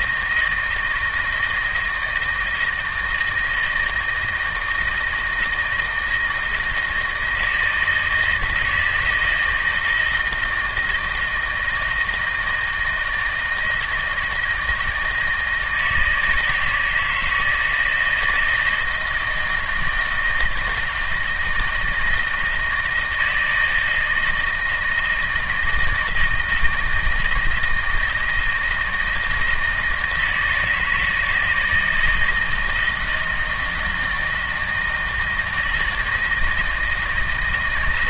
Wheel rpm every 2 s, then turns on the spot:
160, 160, 160, 160, 160, 170, 160, 160, 160, 160, 160, 160, 160, 160, 160, 160, 160, 160, 160.
none